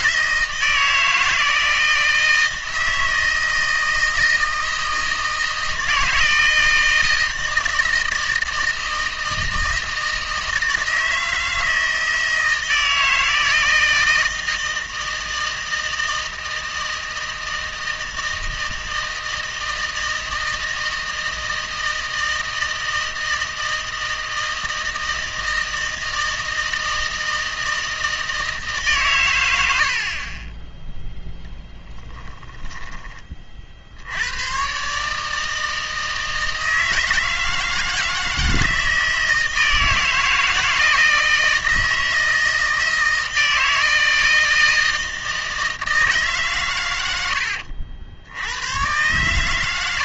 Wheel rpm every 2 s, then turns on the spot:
160, 160, 160, 160, 160, 160, 160, 160, 160, 160, 160, 160, 160, 160, 140, 10, 10, 140, 160, 160, 160, 160, 160, 100, 110.
none